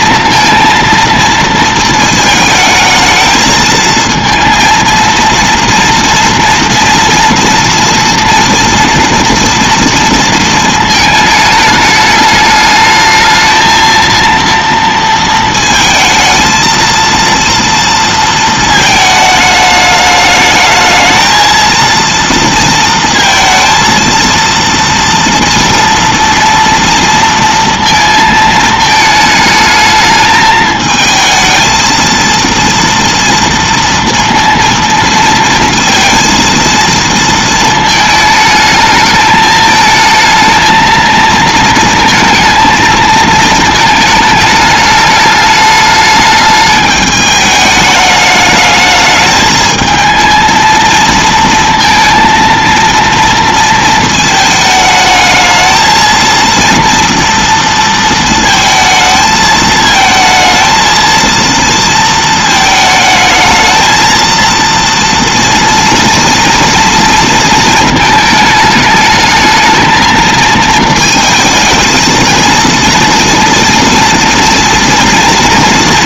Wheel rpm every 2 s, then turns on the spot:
230, 220, 230, 230, 230, 220, 210, 230, 230, 220, 220, 230, 230, 230, 220, 220, 230, 230, 230, 220, 230, 220, 210, 210, 210, 230, 230, 220, 230, 220, 230, 220, 230, 230, 220, 220, 230, 240.
none